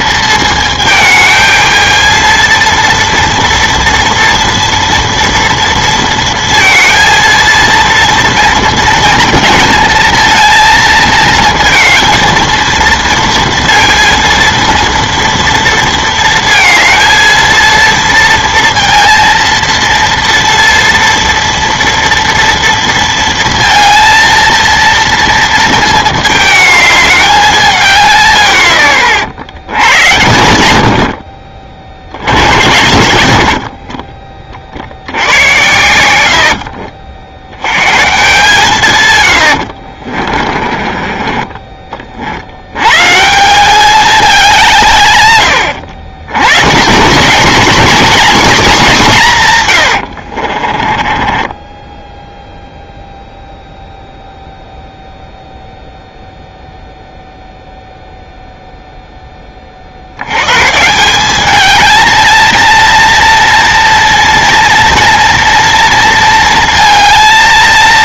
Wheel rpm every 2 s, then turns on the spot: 220, 230, 230, 230, 230, 230, 230, 230, 230, 230, 230, 230, 230, 210, 90, 70, 80, 50, 70, 140, 30, 90, 180, 140, 230, 40, 0, 0, 0, 0, 120, 230, 230, 230.
32-34 36-38 40-42 50-52